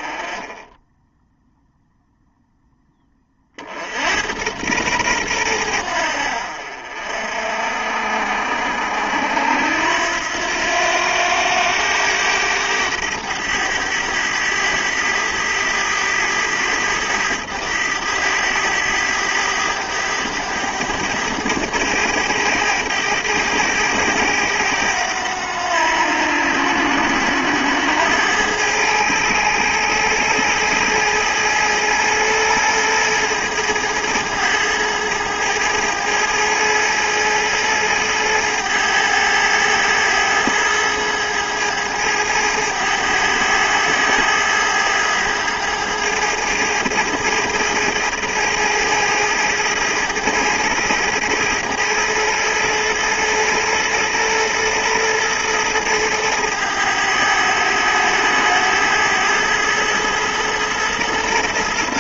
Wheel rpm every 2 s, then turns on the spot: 10, 10, 110, 60, 60, 90, 100, 100, 100, 100, 100, 100, 100, 80, 110, 110, 110, 110, 110, 110, 110, 100, 110, 110, 110, 110, 110, 110, 110, 100, 110.
none